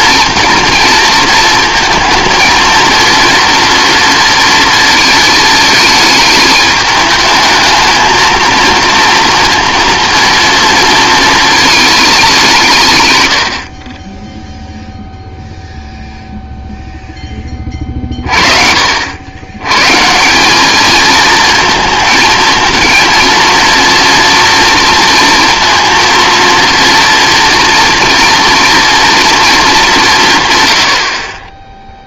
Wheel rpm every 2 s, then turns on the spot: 230, 230, 230, 210, 230, 230, 170, 0, 0, 50, 210, 230, 230, 230, 230, 110.
none